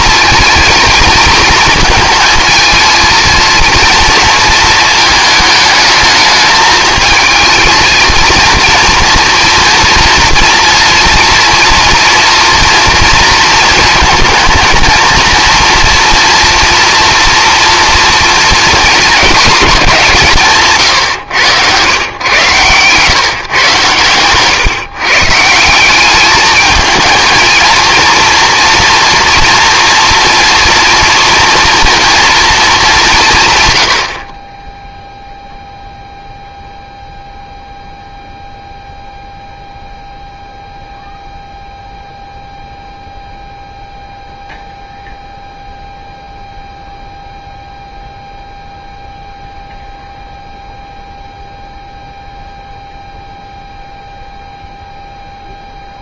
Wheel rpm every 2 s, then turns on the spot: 230, 220, 230, 220, 230, 230, 230, 230, 240, 230, 150, 140, 140, 220, 230, 240, 220, 20, 0, 0, 0, 0, 0, 0, 0, 0, 0, 0.
none